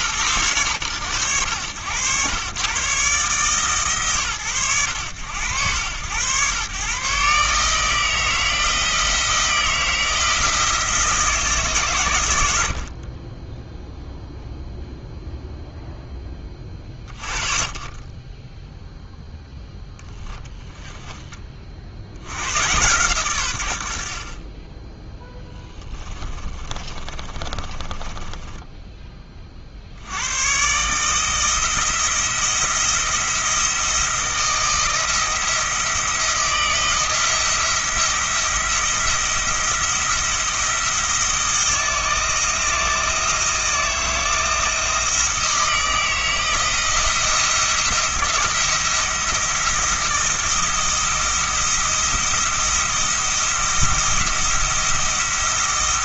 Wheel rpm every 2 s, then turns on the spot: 90, 130, 90, 120, 160, 160, 70, 0, 20, 10, 10, 120, 20, 30, 10, 130, 170, 170, 170, 170, 170, 160, 160, 170, 170, 170, 170, 170.
20-22 26-30